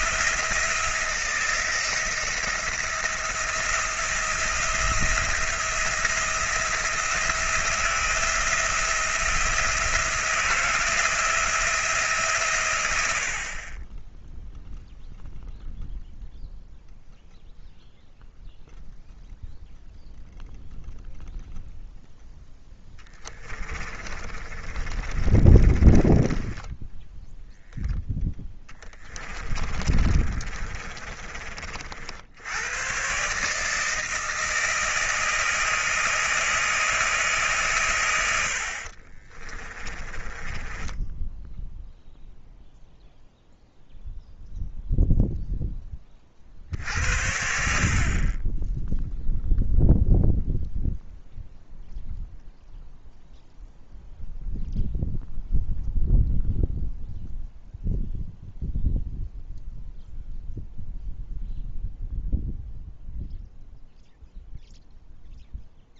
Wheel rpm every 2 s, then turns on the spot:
170, 170, 170, 170, 170, 170, 100, 0, 0, 0, 0, 10, 30, 10, 30, 30, 110, 160, 160, 50, 10, 0, 0, 60, 10, 0, 0, 0, 0, 0, 0, 0, 0.
22-32 38-42